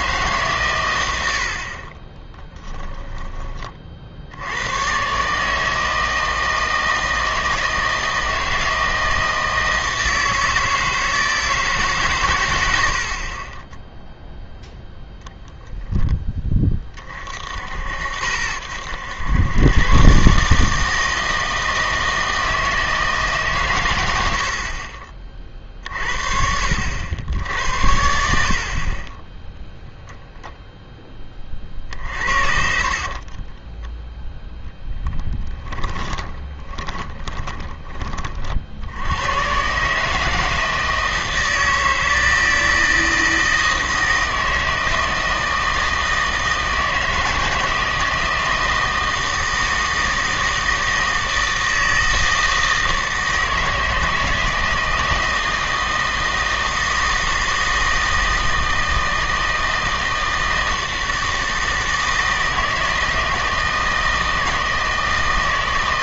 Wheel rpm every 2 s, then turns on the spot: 130, 10, 110, 160, 160, 160, 90, 0, 20, 80, 150, 160, 50, 60, 60, 0, 50, 10, 20, 60, 160, 160, 160, 160, 160, 160, 160, 160, 160, 160, 160, 160, 160.
2-4 24-26 32-38